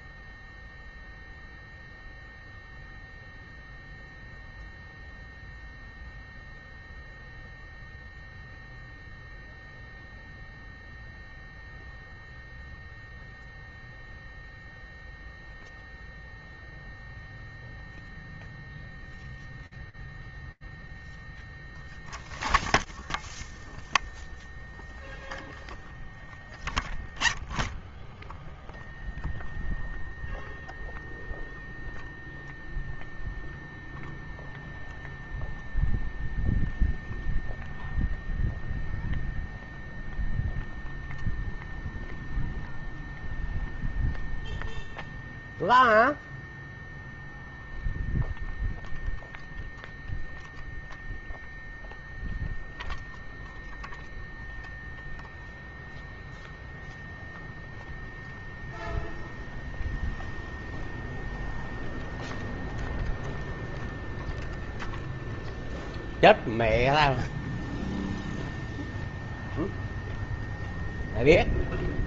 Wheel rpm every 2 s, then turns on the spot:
0, 0, 0, 0, 0, 0, 0, 0, 0, 0, 0, 0, 0, 0, 0, 0, 0, 0, 0, 0, 0, 0, 0, 0, 0, 0, 0, 0, 0, 0, 0, 0, 0, 0, 0, 0.
none